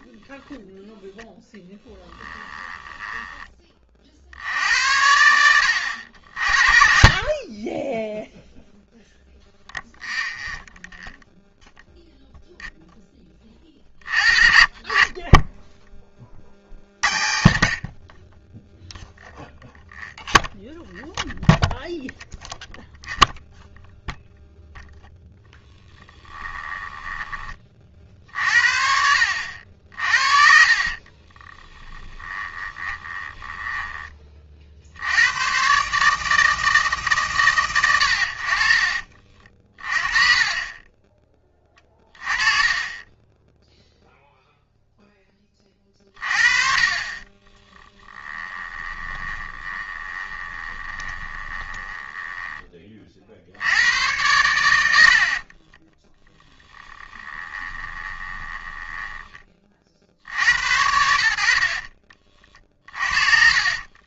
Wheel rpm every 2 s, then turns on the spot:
0, 10, 70, 50, 0, 0, 0, 30, 70, 10, 0, 0, 0, 10, 60, 40, 10, 60, 160, 50, 30, 20, 0, 30, 20, 20, 20, 80, 20, 10, 80, 40.
2-4 26-28 30-34 42-44 48-52 54-60 62-64